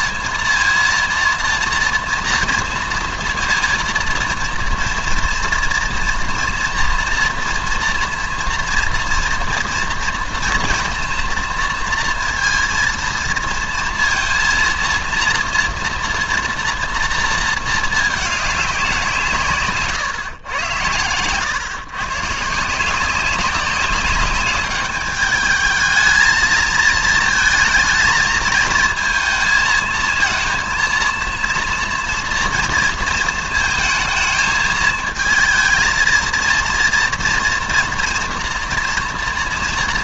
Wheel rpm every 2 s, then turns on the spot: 230, 230, 230, 230, 230, 240, 230, 230, 230, 200, 110, 160, 200, 220, 220, 230, 230, 220, 230, 230.
none